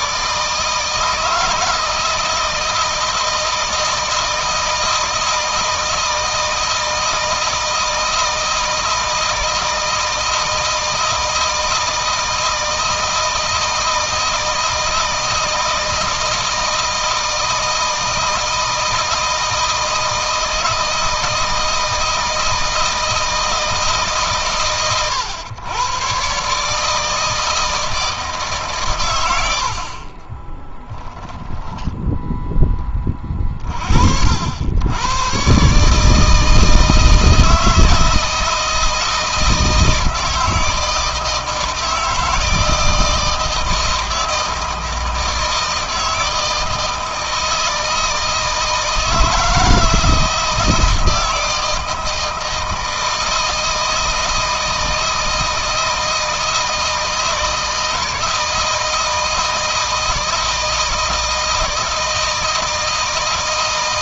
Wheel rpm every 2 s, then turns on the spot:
160, 160, 160, 160, 160, 160, 160, 160, 160, 160, 160, 160, 110, 150, 130, 10, 20, 100, 160, 160, 160, 160, 160, 160, 160, 160, 160, 160, 160, 160, 160, 160.
30-32